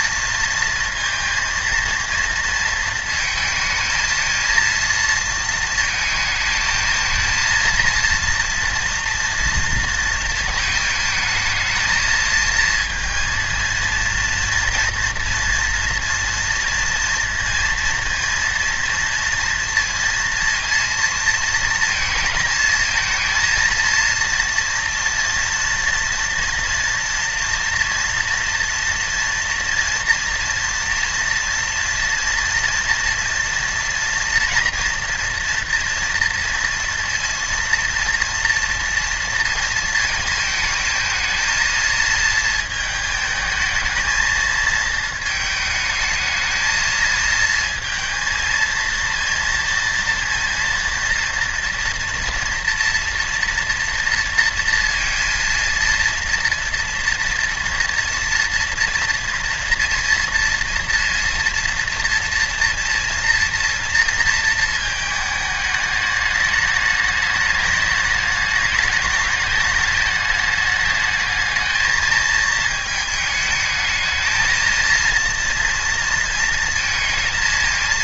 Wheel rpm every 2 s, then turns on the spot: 230, 230, 230, 220, 230, 220, 230, 230, 230, 230, 230, 220, 230, 240, 230, 230, 230, 240, 230, 230, 220, 220, 220, 220, 230, 230, 240, 230, 230, 230, 230, 230, 220, 210, 210, 210, 220, 230, 230.
none